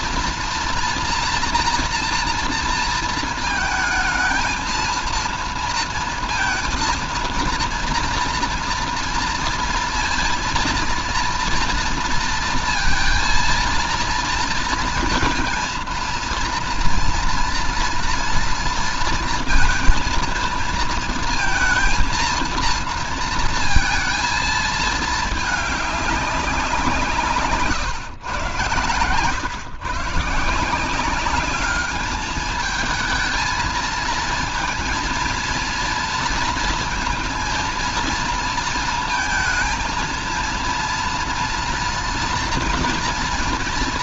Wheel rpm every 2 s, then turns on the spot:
240, 230, 220, 230, 240, 230, 230, 230, 230, 230, 230, 230, 220, 180, 120, 150, 210, 230, 230, 230, 230, 240.
none